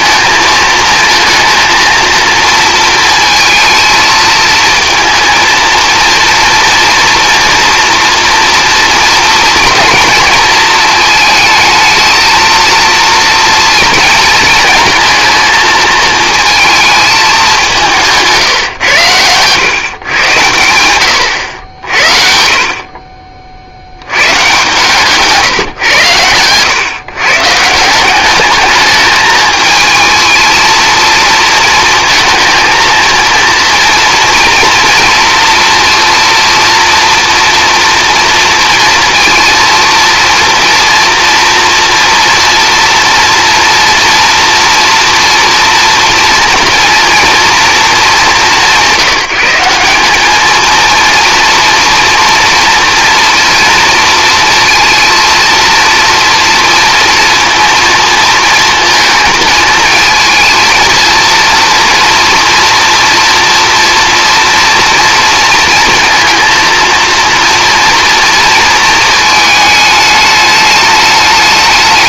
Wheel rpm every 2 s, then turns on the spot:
220, 230, 220, 230, 230, 220, 230, 220, 230, 130, 100, 40, 140, 120, 210, 230, 230, 230, 230, 230, 230, 230, 230, 230, 180, 220, 230, 230, 230, 230, 230, 230, 230, 230, 220, 210.
none